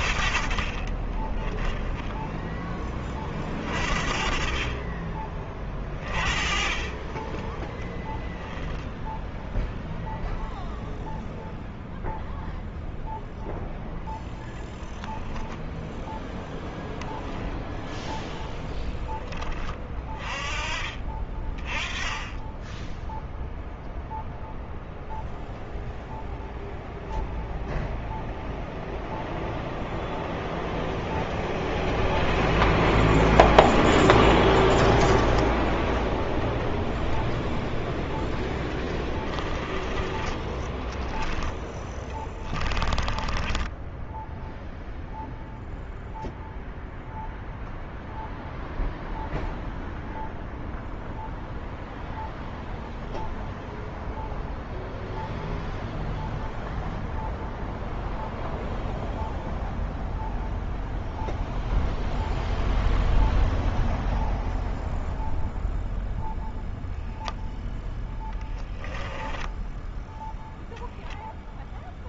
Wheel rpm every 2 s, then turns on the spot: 40, 20, 30, 20, 0, 0, 0, 0, 0, 10, 30, 10, 0, 0, 0, 0, 0, 20, 0, 10, 10, 10, 0, 0, 0, 0, 0, 0, 0, 0, 0, 0, 0, 0, 10, 0.
0-2 38-44 68-70